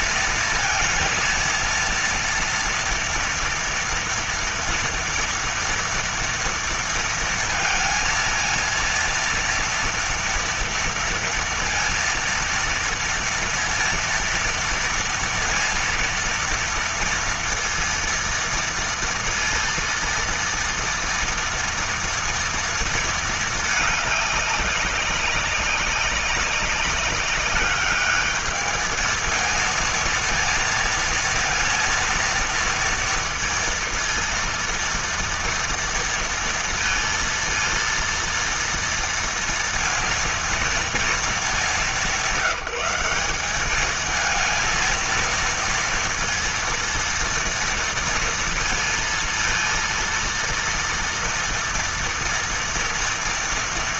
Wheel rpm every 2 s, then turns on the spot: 230, 230, 230, 230, 230, 230, 230, 230, 230, 230, 230, 220, 200, 200, 220, 230, 230, 230, 230, 230, 220, 190, 230, 230, 230, 230, 240.
none